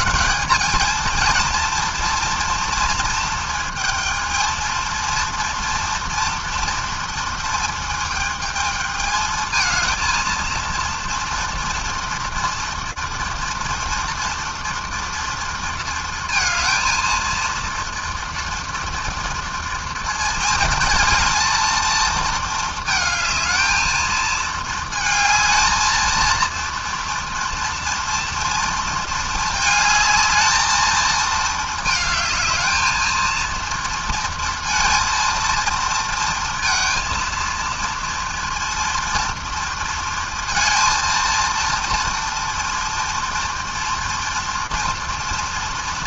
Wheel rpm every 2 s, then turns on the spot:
200, 230, 220, 230, 220, 230, 230, 230, 230, 230, 220, 220, 220, 220, 230, 220, 220, 230, 230, 230, 230, 230, 230.
none